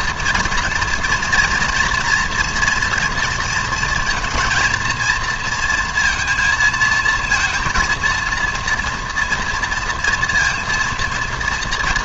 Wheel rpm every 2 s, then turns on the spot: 230, 240, 230, 220, 230, 230.
none